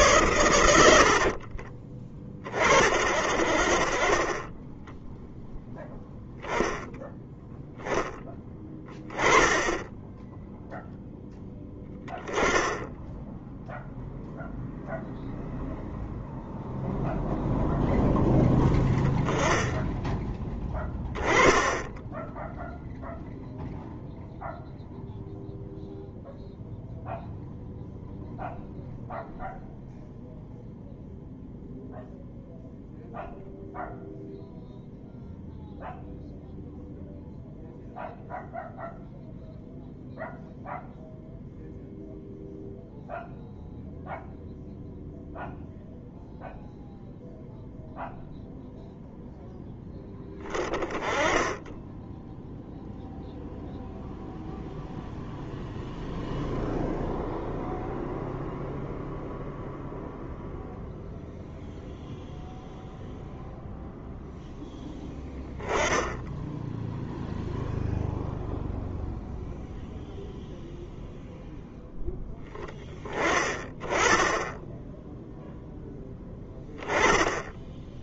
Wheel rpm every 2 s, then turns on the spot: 110, 30, 20, 0, 10, 0, 10, 0, 0, 10, 10, 0, 0, 0, 0, 0, 0, 0, 0, 0, 0, 0, 0, 0, 0, 10, 0, 0, 0, 0, 0, 0, 0, 0, 0, 0, 10, 10, 0.
none